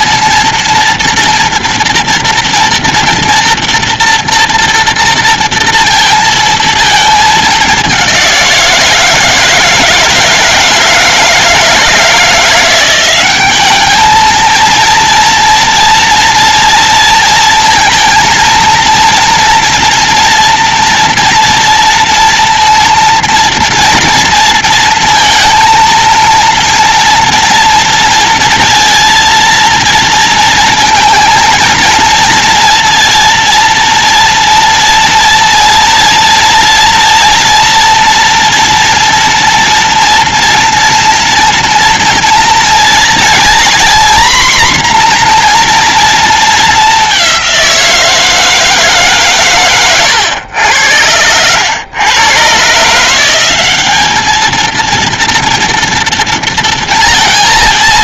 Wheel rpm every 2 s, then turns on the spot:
230, 230, 230, 220, 170, 160, 180, 230, 230, 230, 230, 230, 230, 230, 230, 230, 230, 230, 230, 240, 240, 230, 240, 200, 150, 90, 150, 230, 230.
none